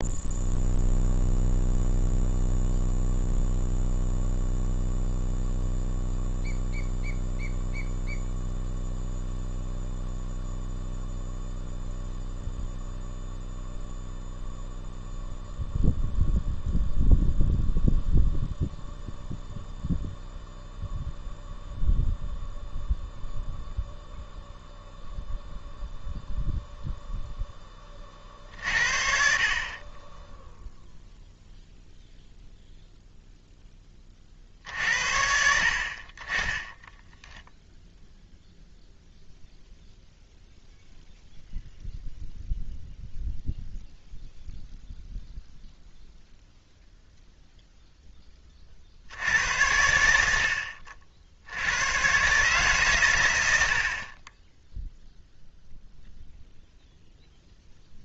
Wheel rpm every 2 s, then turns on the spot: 0, 0, 0, 0, 0, 0, 0, 0, 0, 0, 0, 0, 0, 0, 60, 0, 0, 60, 10, 0, 0, 0, 0, 0, 40, 60, 130, 0, 0.
36-38